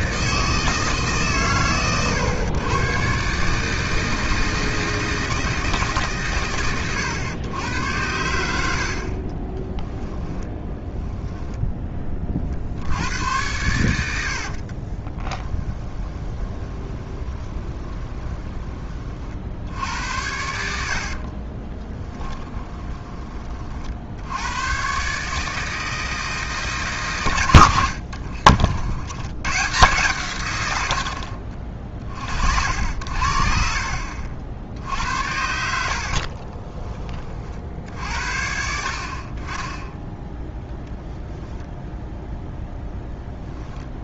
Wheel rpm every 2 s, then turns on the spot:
160, 120, 160, 120, 90, 10, 60, 60, 20, 20, 90, 20, 110, 160, 70, 110, 60, 60, 30, 60, 0, 0.
10-12 14-18 20-24 28-30 36-38